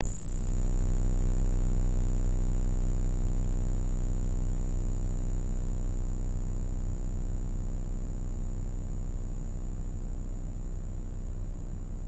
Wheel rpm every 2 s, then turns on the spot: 0, 0, 0, 0, 0, 0.
none